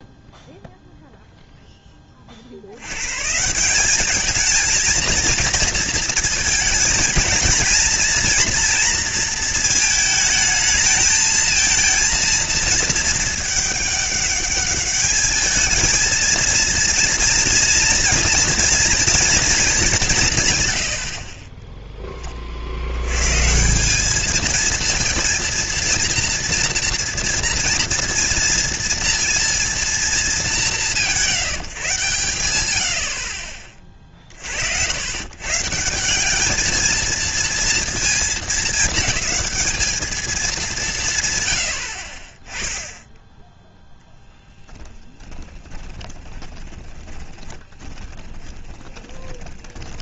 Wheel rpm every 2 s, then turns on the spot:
0, 40, 220, 230, 230, 220, 230, 210, 230, 240, 150, 30, 210, 230, 230, 210, 120, 50, 200, 220, 210, 20, 10, 20, 30.
44-50